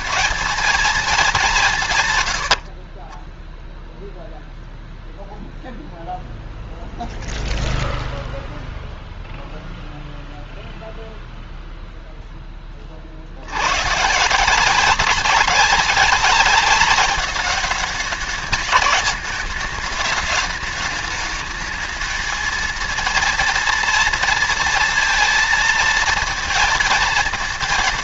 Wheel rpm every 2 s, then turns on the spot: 220, 50, 0, 0, 0, 0, 30, 180, 200, 200, 210, 230, 230, 230.
2-4